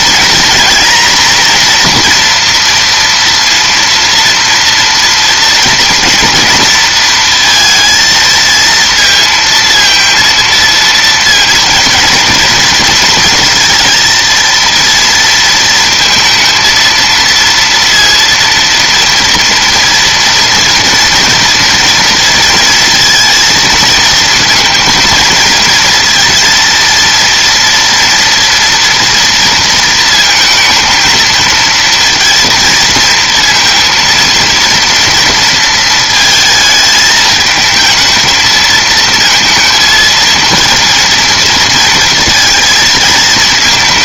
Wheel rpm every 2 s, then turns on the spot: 240, 230, 230, 230, 230, 230, 230, 230, 230, 230, 240, 230, 230, 230, 230, 230, 230, 230, 220, 230, 230, 220.
none